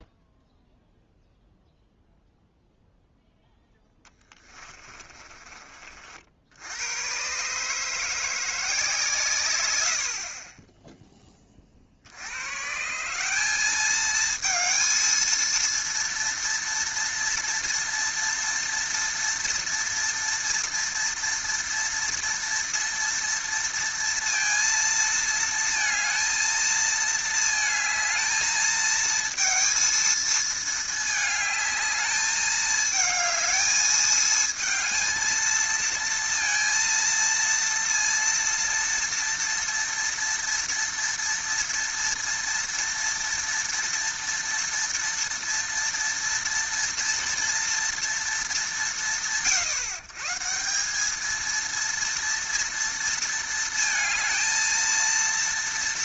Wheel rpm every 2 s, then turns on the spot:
0, 0, 20, 80, 170, 20, 120, 220, 230, 230, 230, 230, 230, 220, 220, 220, 220, 220, 230, 230, 230, 230, 230, 230, 170, 160, 230, 220.
4-6